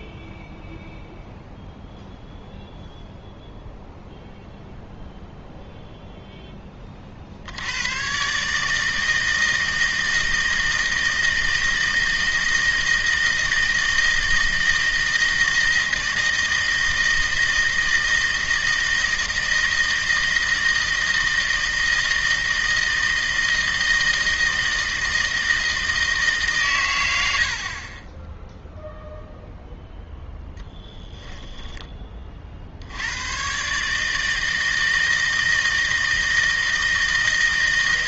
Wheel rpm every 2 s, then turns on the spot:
0, 0, 0, 20, 150, 160, 160, 160, 160, 160, 160, 160, 160, 130, 0, 10, 50, 160, 160.
30-32